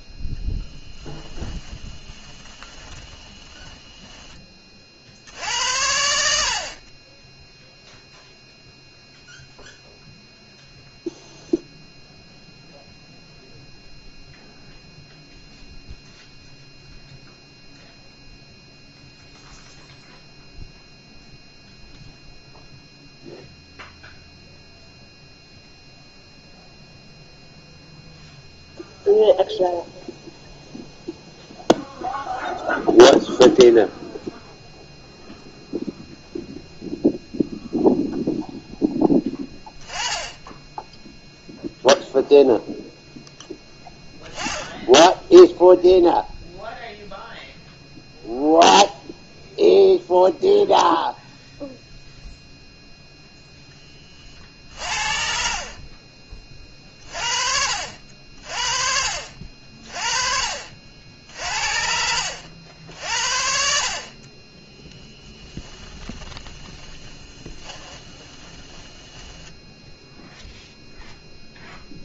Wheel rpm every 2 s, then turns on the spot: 10, 20, 40, 50, 0, 0, 0, 0, 0, 0, 0, 0, 0, 0, 0, 0, 0, 0, 0, 10, 10, 0, 10, 0, 0, 0, 0, 50, 30, 50, 60, 70, 10, 20, 20, 0.
0-4 66-70